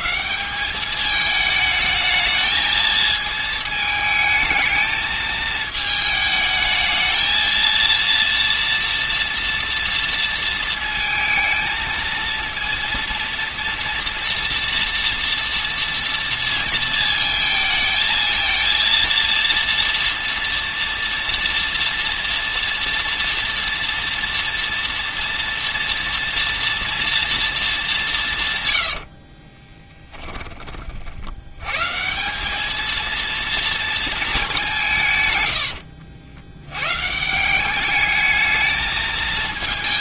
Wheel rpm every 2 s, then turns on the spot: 200, 220, 220, 220, 230, 220, 230, 230, 220, 230, 230, 230, 240, 230, 100, 40, 220, 170, 120, 220.
28-30